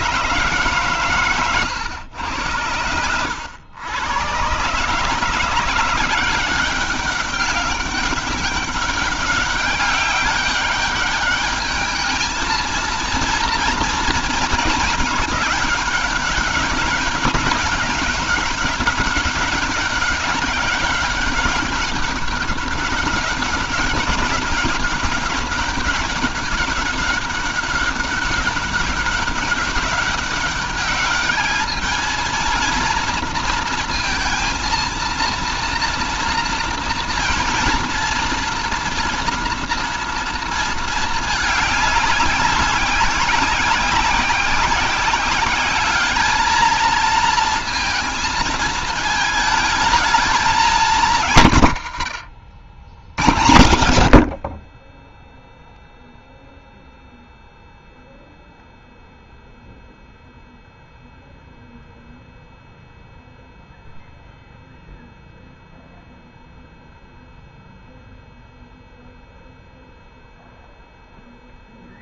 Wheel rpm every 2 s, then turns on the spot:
140, 100, 130, 190, 200, 200, 220, 220, 200, 200, 190, 200, 190, 200, 200, 200, 230, 230, 230, 240, 220, 200, 190, 220, 220, 210, 90, 30, 0, 0, 0, 0, 0, 0, 0, 0.
none